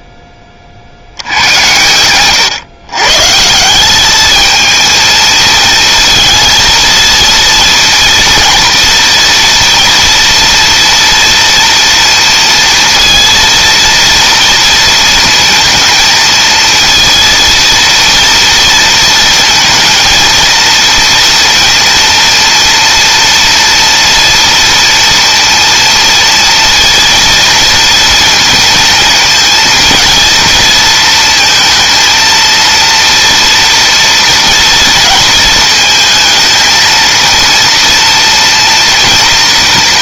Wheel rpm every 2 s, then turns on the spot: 60, 140, 220, 230, 230, 230, 230, 230, 220, 230, 230, 230, 230, 230, 230, 230, 230, 220, 220, 230.
none